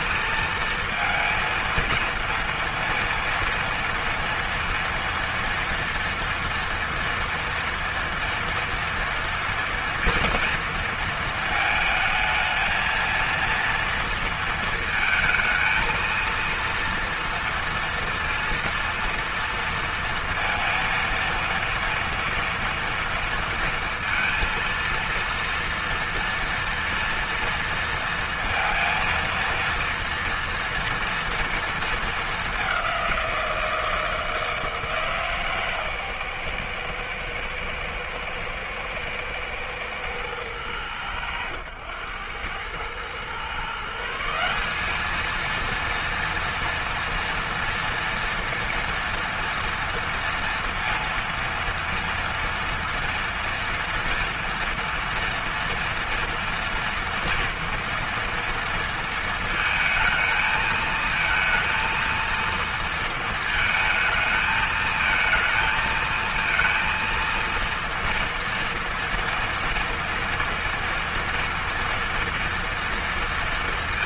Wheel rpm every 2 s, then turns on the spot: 230, 230, 230, 240, 230, 230, 220, 230, 230, 230, 230, 230, 230, 230, 230, 230, 200, 160, 120, 110, 110, 100, 180, 230, 230, 230, 240, 230, 230, 230, 220, 230, 220, 230, 230, 230, 230.
none